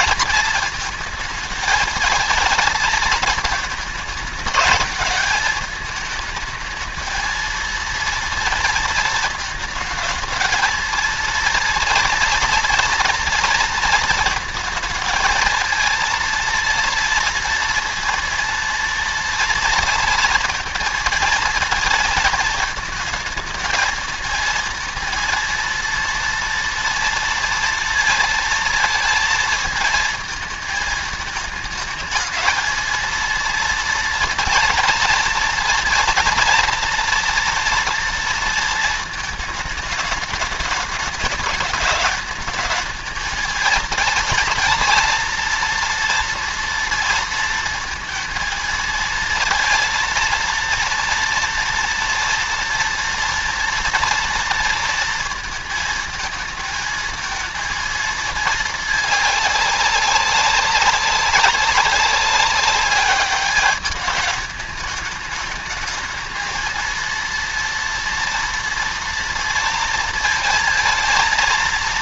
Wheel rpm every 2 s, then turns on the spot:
220, 220, 220, 230, 230, 230, 230, 230, 230, 230, 230, 220, 230, 230, 220, 220, 230, 230, 230, 220, 210, 220, 230, 230, 220, 230, 230, 230, 220, 210, 190, 200, 210, 230, 230, 220.
none